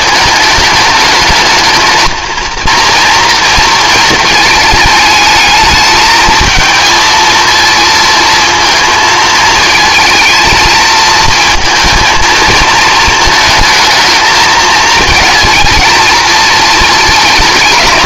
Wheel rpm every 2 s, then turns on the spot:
210, 230, 220, 220, 220, 230, 230, 220, 220.
none